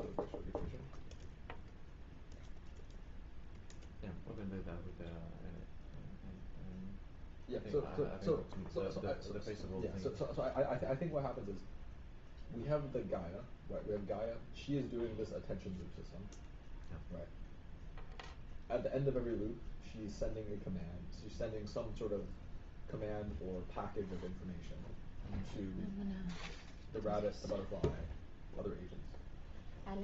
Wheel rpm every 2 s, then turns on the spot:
0, 0, 0, 0, 0, 0, 0, 0, 0, 0, 0, 0, 0, 0, 0.
none